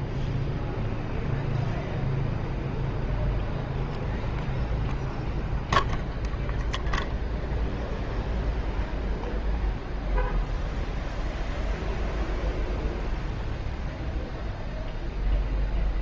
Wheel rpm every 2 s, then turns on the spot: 0, 0, 0, 0, 0, 0, 0, 0.
none